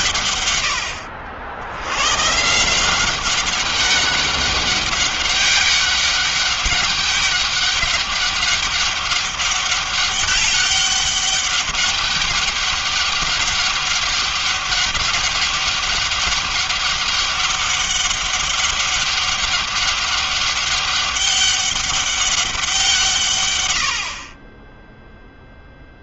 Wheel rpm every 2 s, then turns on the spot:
140, 150, 200, 200, 200, 200, 200, 200, 200, 200, 200, 190, 40.
none